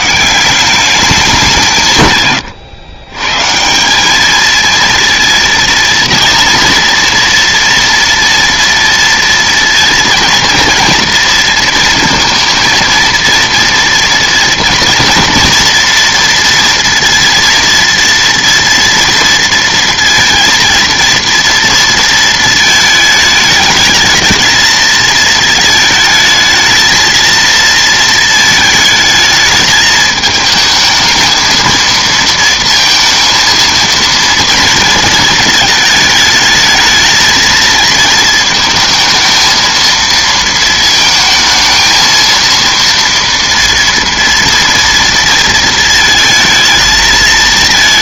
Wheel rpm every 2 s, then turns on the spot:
190, 120, 230, 230, 230, 230, 230, 240, 230, 230, 230, 220, 220, 220, 220, 220, 230, 230, 220, 230, 220, 230, 230, 220.
none